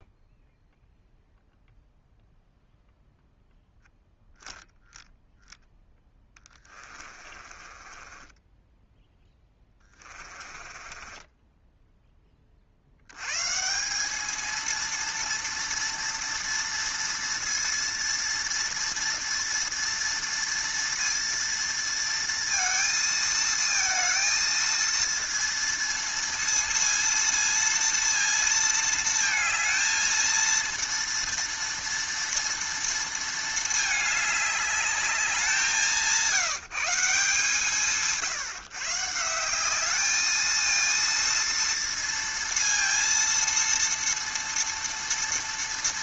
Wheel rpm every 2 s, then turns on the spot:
0, 0, 0, 20, 10, 20, 70, 230, 230, 230, 230, 230, 230, 230, 220, 230, 230, 210, 180, 150, 230, 230, 230.
6-12